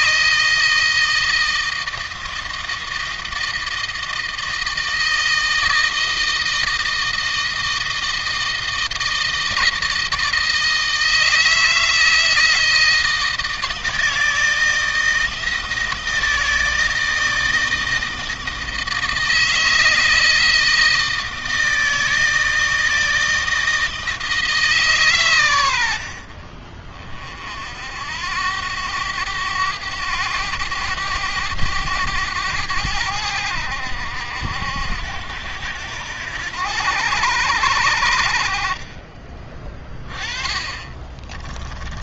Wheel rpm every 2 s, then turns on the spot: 160, 160, 160, 160, 160, 160, 160, 160, 160, 160, 160, 160, 150, 40, 90, 100, 90, 70, 90, 40, 20.
40-42